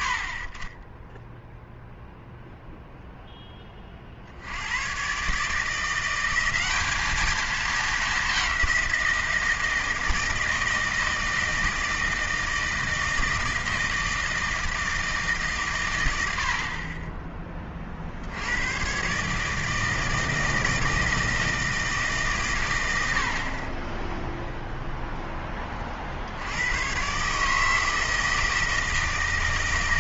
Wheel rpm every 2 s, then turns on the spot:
40, 0, 90, 200, 190, 160, 160, 160, 50, 110, 160, 120, 0, 100, 160.
none